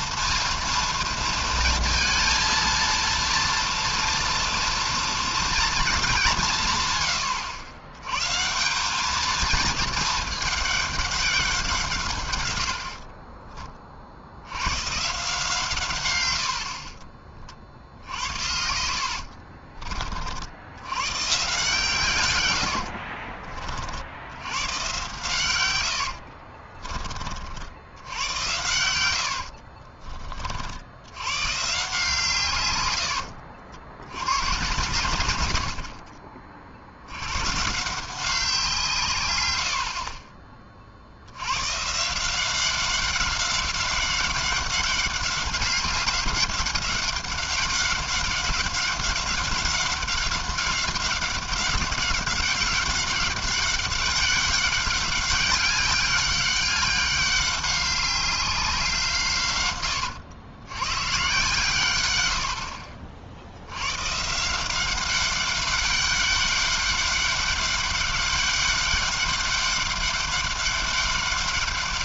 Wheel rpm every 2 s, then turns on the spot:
230, 230, 230, 170, 130, 210, 120, 80, 80, 60, 60, 110, 90, 50, 100, 50, 140, 110, 40, 180, 40, 180, 200, 190, 190, 200, 190, 190, 190, 190, 110, 80, 170, 200, 200, 200.
18-20 26-28